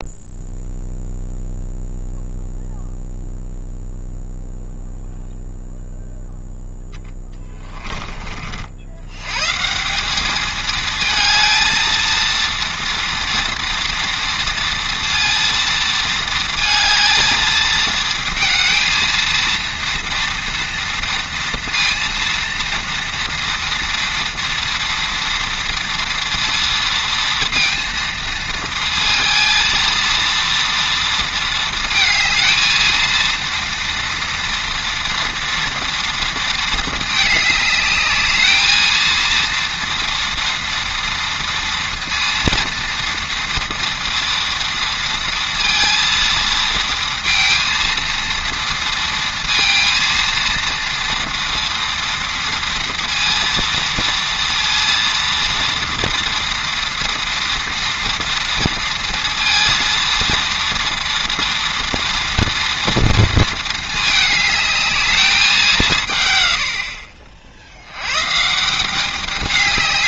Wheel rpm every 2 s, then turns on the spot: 0, 0, 0, 0, 60, 220, 230, 230, 230, 230, 230, 230, 230, 230, 230, 230, 220, 230, 220, 220, 230, 230, 230, 230, 230, 230, 230, 230, 230, 230, 230, 240, 210, 80, 170.
none